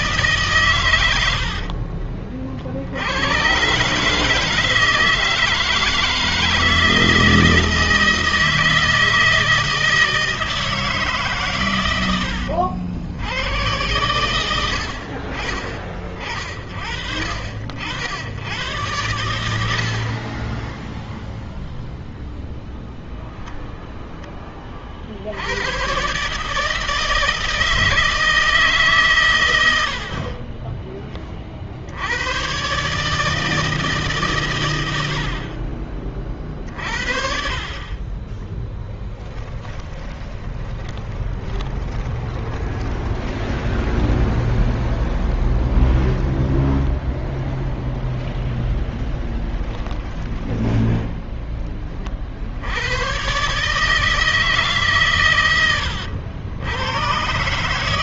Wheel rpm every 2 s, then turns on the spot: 100, 70, 160, 160, 160, 150, 100, 50, 60, 100, 10, 0, 50, 160, 140, 30, 140, 80, 60, 10, 20, 20, 10, 10, 10, 10, 100, 140, 110.
30-32 38-44